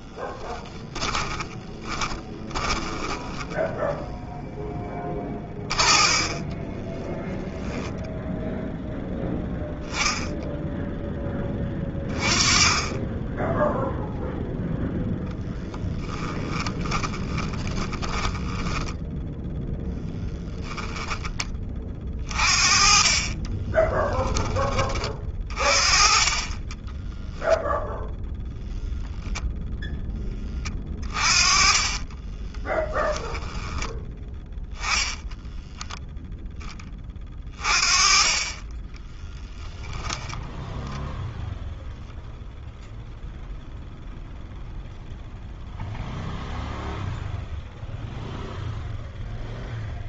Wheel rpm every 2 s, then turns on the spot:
10, 20, 10, 10, 0, 0, 20, 0, 10, 10, 10, 40, 20, 10, 0, 20, 10, 10, 30, 20, 0, 0, 0, 0, 0.
0-8 16-24 26-28 30-36